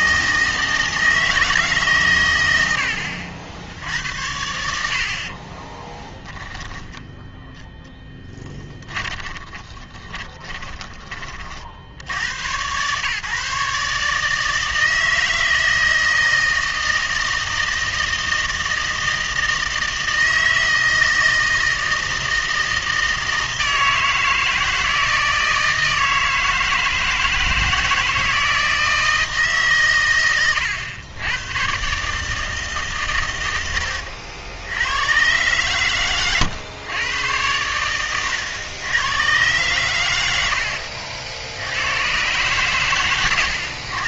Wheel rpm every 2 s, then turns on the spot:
160, 100, 70, 10, 20, 20, 110, 160, 160, 160, 160, 160, 160, 160, 160, 120, 150, 90, 110, 110, 70, 130.
8-12